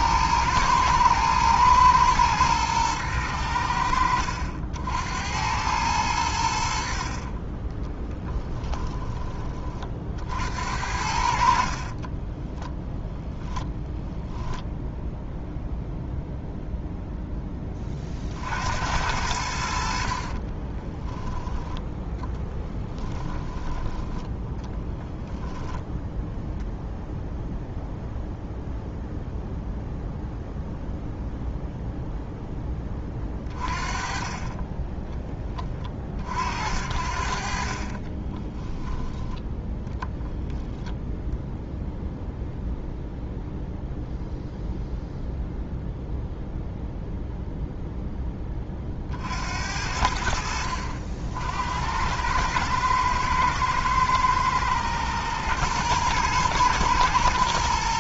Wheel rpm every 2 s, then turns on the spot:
110, 110, 70, 60, 10, 70, 10, 0, 0, 70, 10, 20, 20, 0, 0, 0, 20, 20, 60, 10, 0, 0, 0, 0, 40, 60, 110, 110, 120.
8-10 12-14 20-26